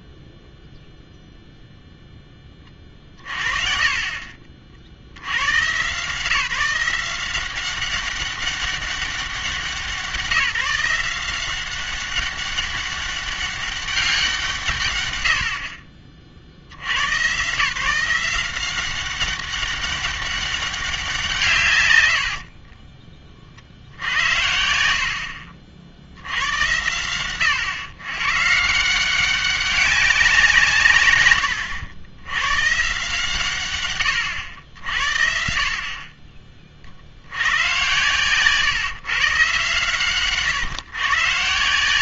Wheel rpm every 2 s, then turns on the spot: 0, 10, 50, 160, 200, 180, 200, 140, 80, 180, 200, 40, 70, 100, 150, 160, 120, 80, 40, 140, 130.
4-6 22-24